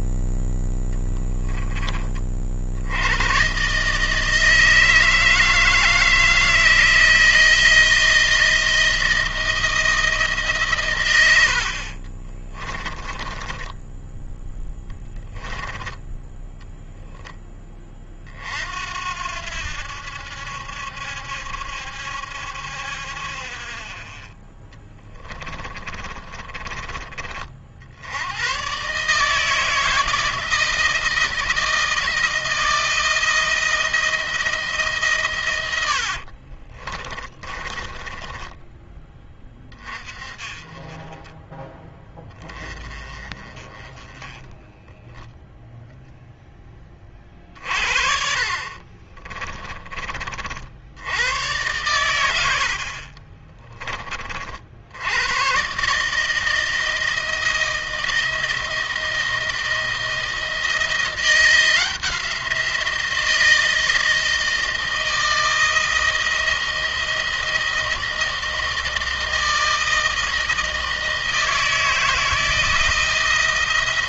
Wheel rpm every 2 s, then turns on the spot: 0, 80, 160, 160, 170, 130, 20, 10, 0, 70, 70, 60, 20, 20, 130, 160, 170, 150, 30, 20, 20, 20, 10, 20, 50, 80, 50, 70, 160, 160, 170, 170, 160, 170, 160, 160, 160.
12-14 24-26 36-38 48-50 52-54